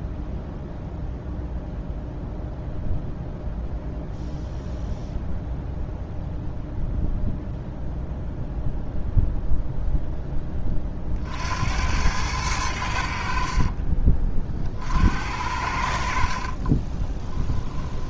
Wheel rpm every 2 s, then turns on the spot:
0, 0, 0, 0, 0, 30, 90, 50, 30.
16-18